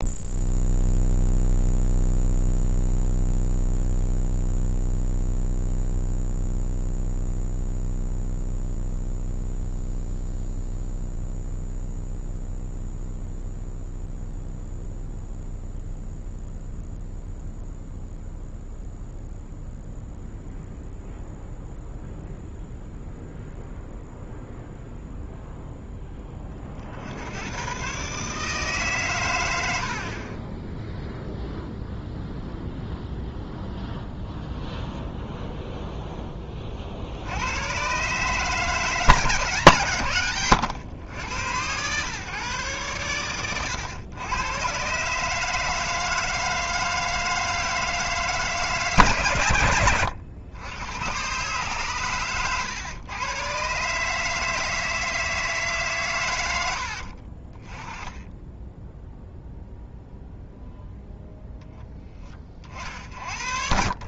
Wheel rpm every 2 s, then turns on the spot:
0, 0, 0, 0, 0, 0, 0, 0, 0, 0, 0, 0, 0, 50, 140, 10, 0, 0, 40, 150, 120, 130, 120, 160, 150, 110, 110, 160, 90, 10, 0, 40.
56-58